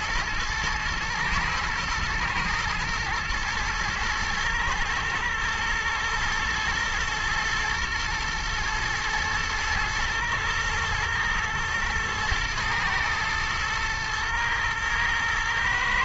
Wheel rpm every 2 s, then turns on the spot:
110, 120, 110, 110, 120, 120, 110, 110.
none